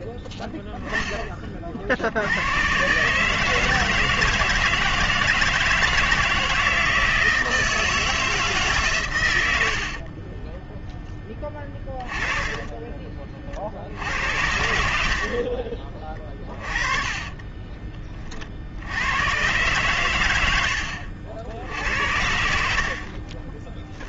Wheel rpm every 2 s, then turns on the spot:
10, 100, 160, 160, 150, 10, 20, 70, 30, 50, 80, 50.
10-14 16-18